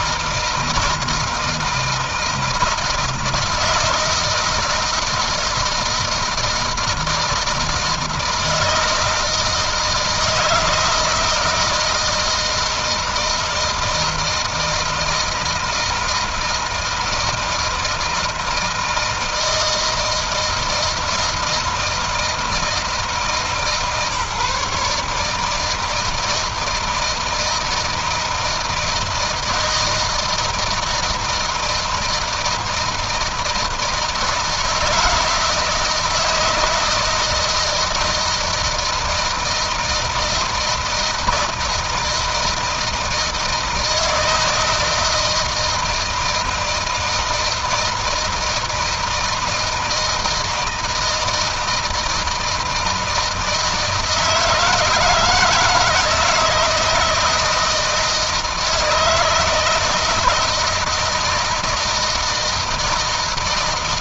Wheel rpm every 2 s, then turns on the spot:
160, 160, 160, 160, 160, 160, 160, 160, 160, 160, 160, 160, 140, 160, 160, 160, 160, 160, 160, 170, 160, 160, 160, 160, 160, 160, 160, 160, 160, 160, 160, 160.
none